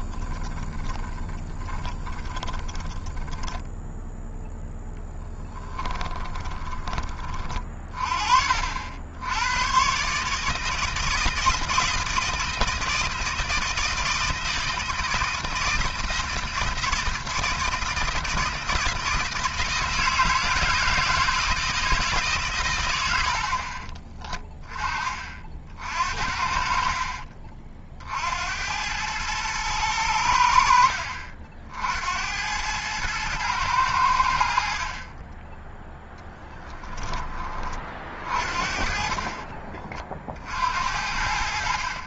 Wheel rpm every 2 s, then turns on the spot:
20, 20, 0, 20, 60, 150, 160, 160, 160, 160, 160, 110, 20, 50, 80, 70, 90, 60, 20, 40, 60.
0-4 6-8 36-38